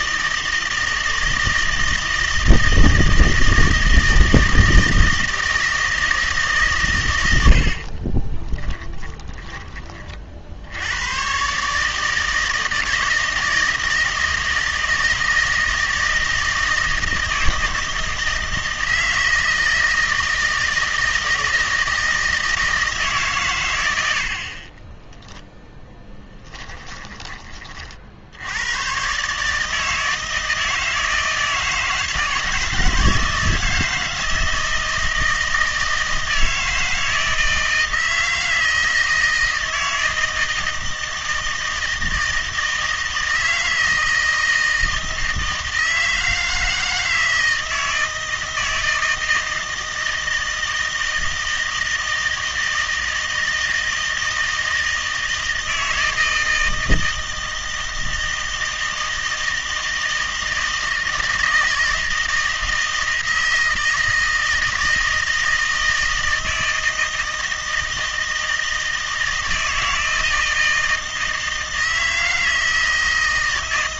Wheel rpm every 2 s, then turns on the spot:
160, 160, 160, 140, 20, 80, 160, 160, 160, 160, 160, 160, 30, 10, 100, 160, 160, 160, 170, 160, 160, 160, 160, 160, 160, 160, 160, 160, 160, 160, 160, 160, 160, 160, 160, 160, 160.
8-10 26-28